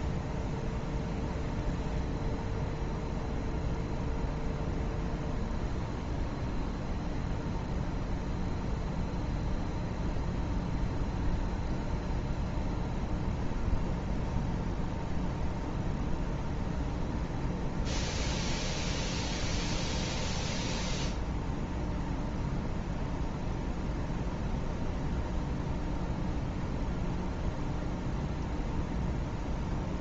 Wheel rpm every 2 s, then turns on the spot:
0, 0, 0, 0, 0, 0, 0, 0, 0, 0, 0, 0, 0, 0, 0.
none